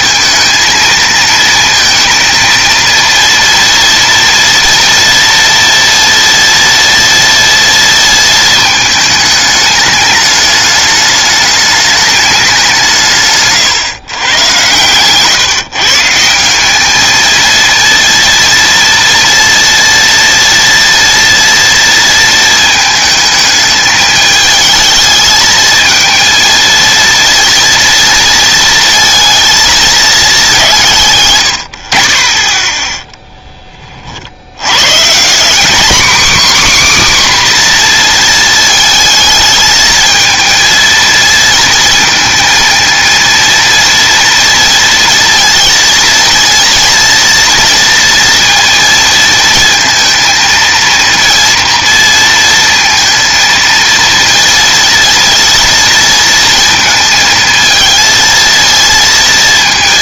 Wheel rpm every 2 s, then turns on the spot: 220, 230, 230, 230, 220, 210, 200, 120, 180, 230, 230, 220, 220, 230, 220, 190, 20, 90, 280, 230, 230, 230, 230, 230, 230, 230, 230, 230, 230, 220.
none